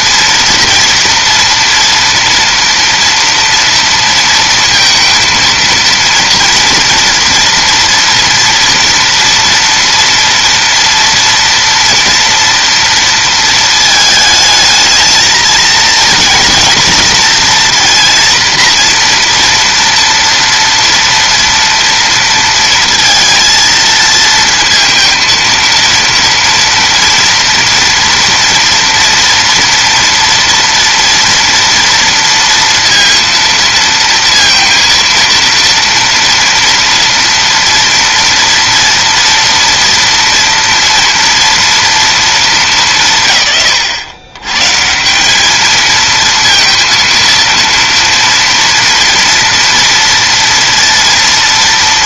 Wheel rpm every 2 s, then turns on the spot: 230, 230, 230, 230, 230, 240, 230, 220, 230, 240, 230, 230, 230, 230, 230, 230, 230, 230, 230, 230, 230, 200, 140, 230, 230, 230.
none